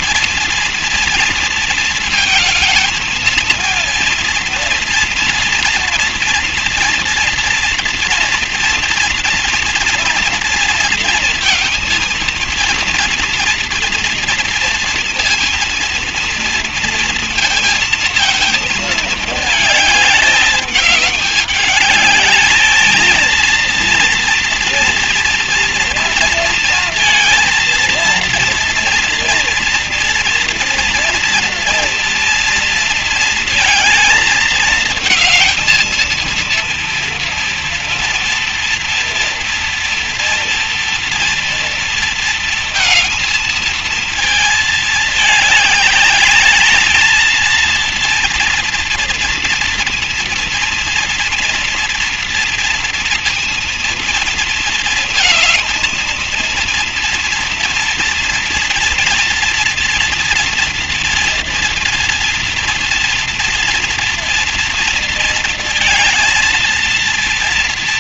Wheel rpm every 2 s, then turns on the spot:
230, 220, 230, 230, 240, 230, 230, 230, 230, 230, 210, 210, 230, 230, 230, 230, 230, 220, 230, 230, 230, 230, 230, 210, 230, 240, 230, 230, 230, 240, 240, 240, 230, 230.
none